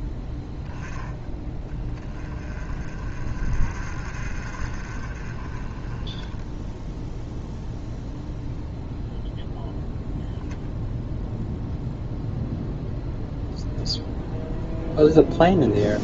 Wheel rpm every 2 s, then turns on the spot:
10, 30, 40, 10, 0, 0, 0, 0.
none